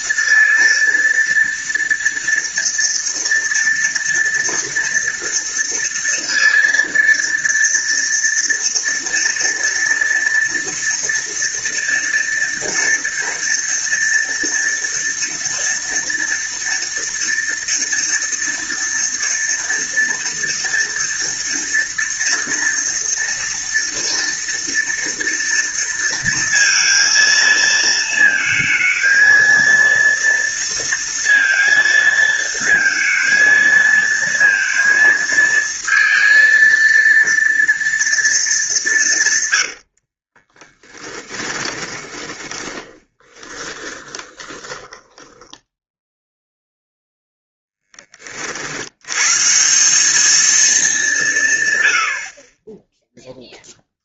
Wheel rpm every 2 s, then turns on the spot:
230, 230, 230, 230, 230, 230, 230, 230, 230, 230, 230, 230, 230, 230, 230, 230, 230, 230, 230, 190, 30, 20, 20, 0, 70, 210, 20.
40-46